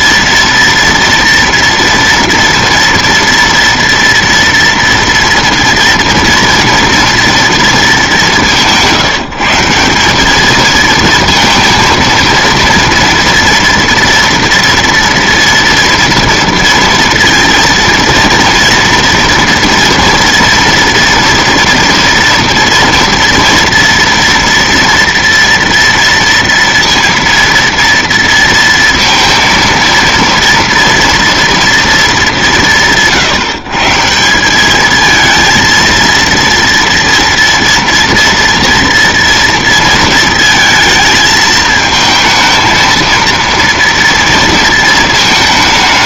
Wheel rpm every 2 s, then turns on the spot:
230, 240, 230, 230, 180, 220, 230, 230, 230, 240, 230, 230, 230, 230, 230, 230, 180, 200, 230, 240, 230, 220, 230.
none